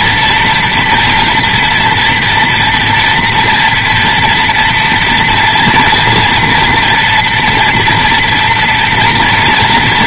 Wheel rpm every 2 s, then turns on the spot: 240, 230, 230, 240, 230.
none